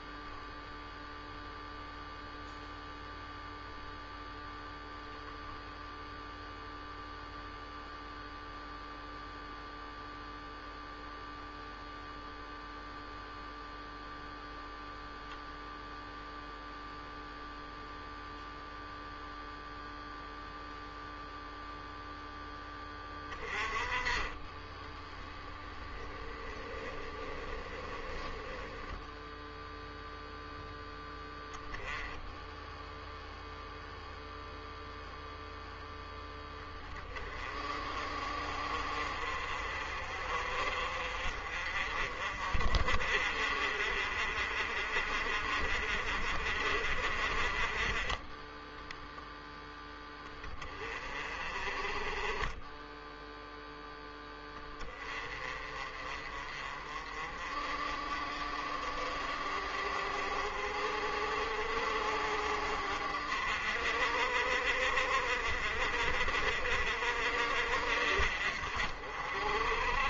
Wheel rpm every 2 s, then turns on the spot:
0, 0, 0, 0, 0, 0, 0, 0, 0, 0, 0, 0, 20, 10, 10, 0, 10, 0, 10, 40, 40, 40, 40, 40, 10, 10, 20, 10, 40, 40, 50, 50, 50, 40, 50.
24-26 28-30 52-54